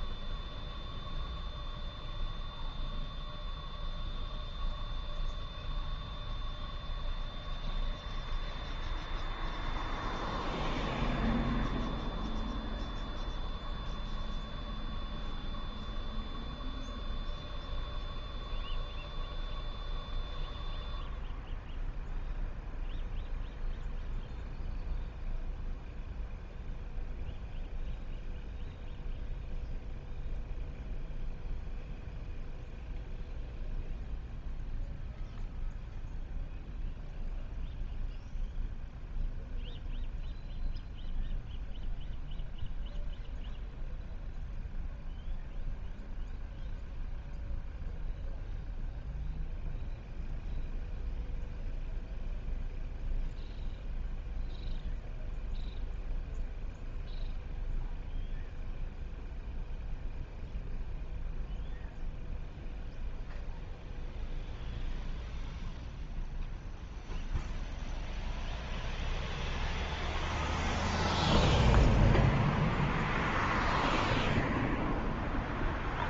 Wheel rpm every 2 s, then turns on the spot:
0, 0, 0, 0, 0, 0, 0, 0, 0, 0, 0, 0, 0, 0, 0, 0, 0, 0, 0, 0, 0, 0, 0, 0, 0, 0, 0, 0, 0, 0, 0, 0, 0, 0, 0, 0, 0, 0.
none